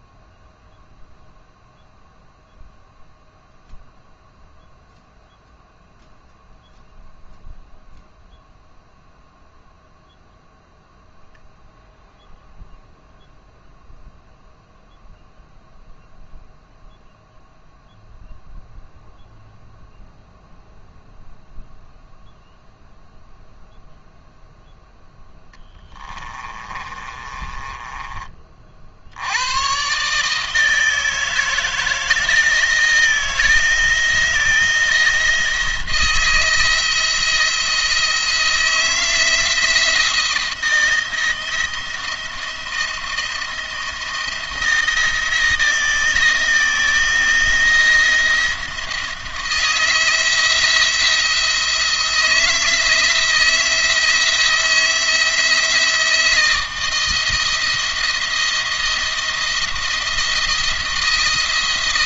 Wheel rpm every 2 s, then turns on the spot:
0, 0, 0, 0, 0, 0, 0, 0, 0, 0, 0, 0, 0, 20, 50, 160, 160, 170, 160, 170, 170, 170, 170, 160, 160, 160, 170, 170, 160, 170, 170.
26-28